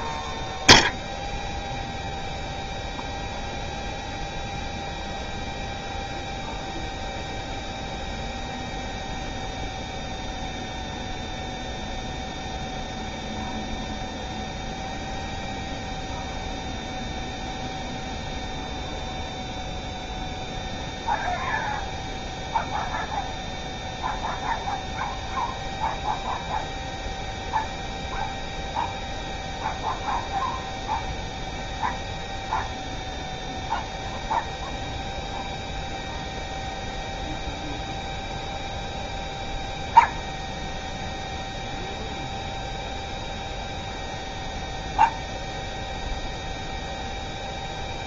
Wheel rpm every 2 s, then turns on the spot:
0, 0, 0, 0, 0, 0, 0, 0, 0, 0, 0, 0, 0, 0, 0, 0, 0, 0, 0, 0, 0, 0, 0, 0.
none